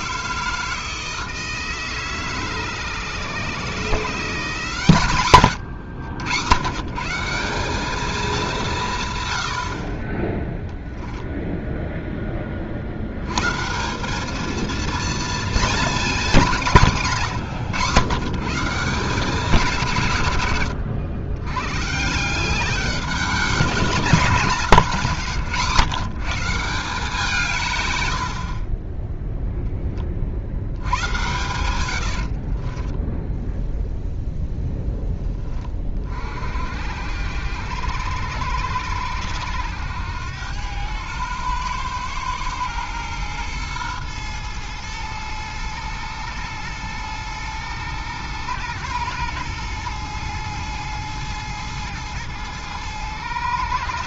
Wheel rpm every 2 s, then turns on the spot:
160, 140, 140, 140, 170, 0, 70, 230, 150, 180, 80, 190, 160, 170, 30, 90, 20, 10, 70, 80, 100, 110, 110, 110, 110, 110, 110.
32-34